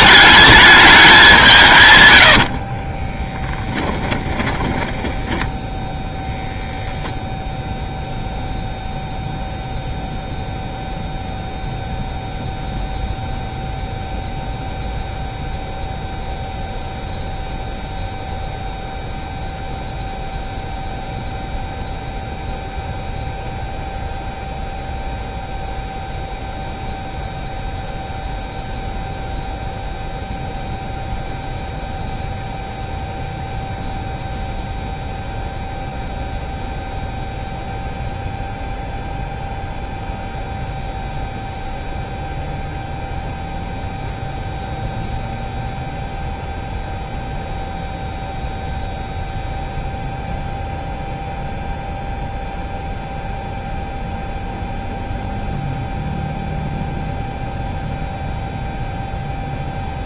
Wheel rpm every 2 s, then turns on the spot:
210, 70, 20, 10, 0, 0, 0, 0, 0, 0, 0, 0, 0, 0, 0, 0, 0, 0, 0, 0, 0, 0, 0, 0, 0, 0, 0, 0, 0, 0.
2-6